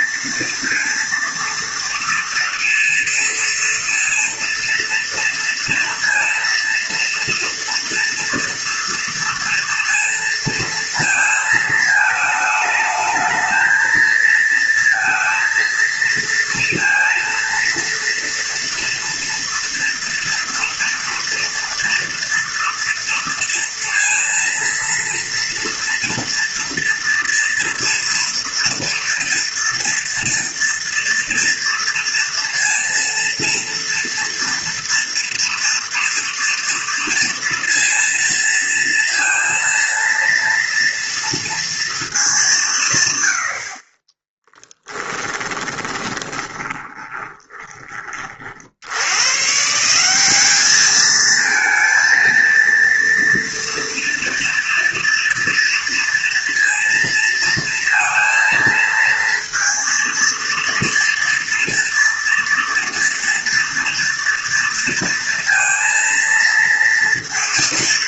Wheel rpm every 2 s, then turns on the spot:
230, 230, 230, 230, 230, 230, 210, 230, 230, 230, 240, 230, 230, 230, 230, 230, 230, 230, 230, 230, 230, 160, 20, 20, 70, 210, 230, 230, 230, 230, 230, 230, 230, 230.
44-48